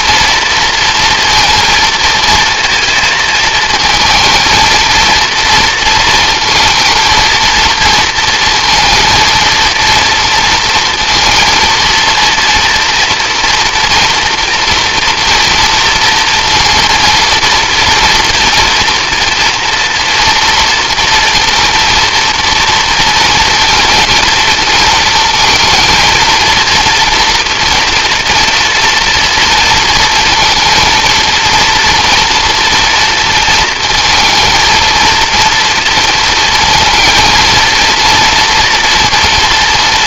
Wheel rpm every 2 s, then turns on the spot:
230, 220, 230, 220, 230, 230, 230, 230, 230, 230, 230, 230, 230, 230, 230, 230, 230, 230, 230, 230.
none